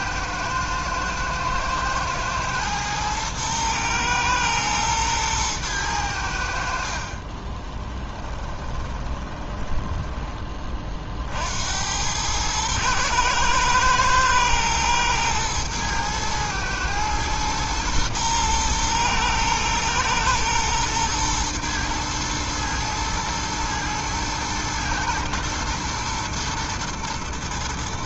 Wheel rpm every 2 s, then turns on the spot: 110, 110, 110, 70, 20, 20, 110, 110, 110, 110, 110, 110, 110, 120.
8-10